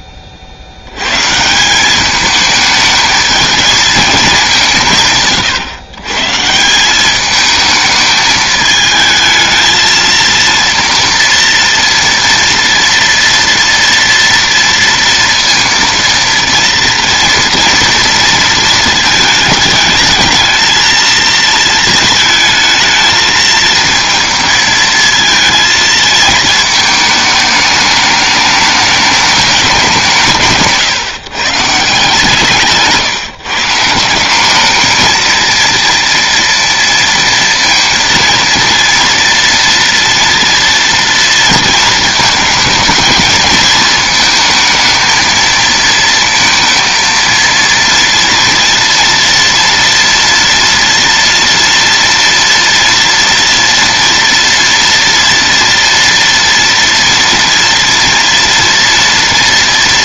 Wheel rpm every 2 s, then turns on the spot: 80, 220, 190, 170, 220, 230, 230, 230, 230, 230, 220, 220, 220, 220, 210, 150, 150, 210, 230, 230, 230, 220, 220, 230, 230, 230, 230, 230, 230, 230.
30-32